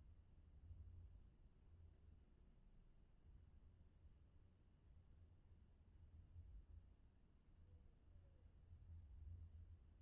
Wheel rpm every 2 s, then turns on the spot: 0, 0, 0, 0, 0.
none